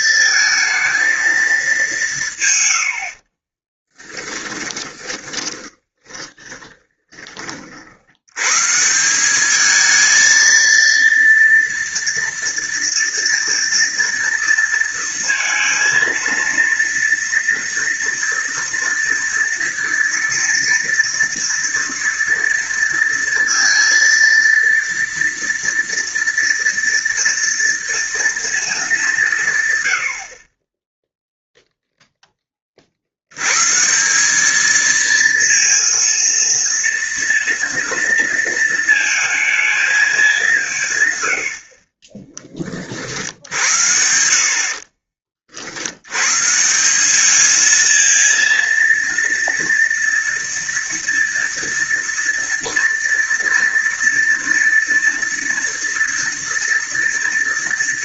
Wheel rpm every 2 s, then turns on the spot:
220, 60, 20, 20, 180, 230, 230, 230, 230, 230, 230, 230, 230, 230, 180, 0, 60, 220, 230, 230, 110, 50, 50, 200, 230, 230, 230, 230, 230.
2-6